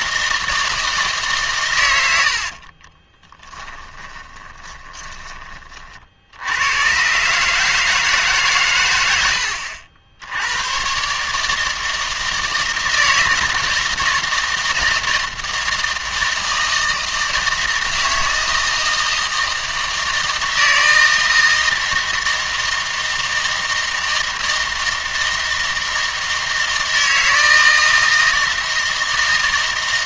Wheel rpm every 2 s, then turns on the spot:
160, 40, 20, 90, 130, 110, 160, 160, 160, 160, 160, 160, 160, 160, 160.
2-6